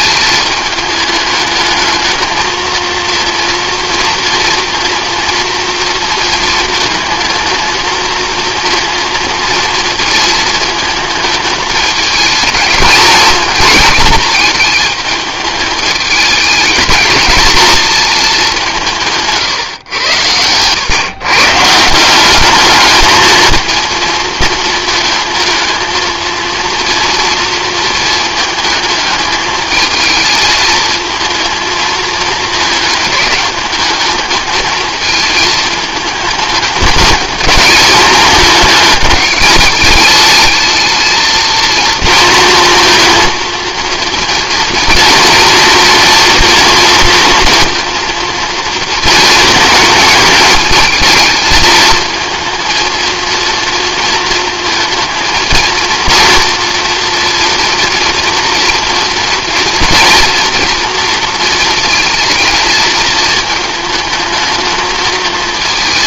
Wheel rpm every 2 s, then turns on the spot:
220, 230, 230, 220, 230, 220, 220, 210, 210, 200, 120, 210, 220, 230, 220, 220, 220, 220, 210, 220, 220, 230, 230, 230, 220, 220, 230, 230, 230, 230, 230, 230, 220.
none